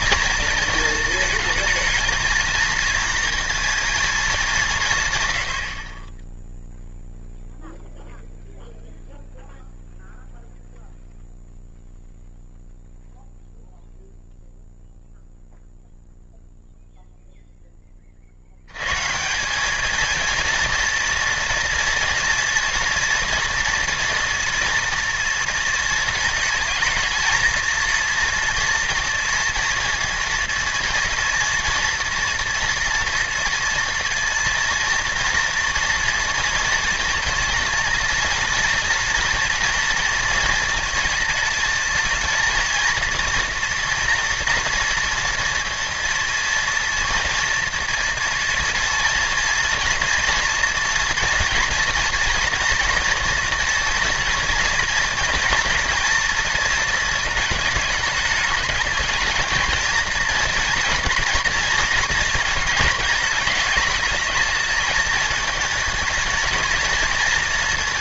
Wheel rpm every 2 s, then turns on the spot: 230, 220, 220, 30, 0, 0, 0, 0, 0, 80, 230, 230, 230, 220, 230, 230, 230, 230, 230, 230, 230, 230, 230, 230, 240, 230, 230, 230, 230, 210, 220, 220, 220, 230.
none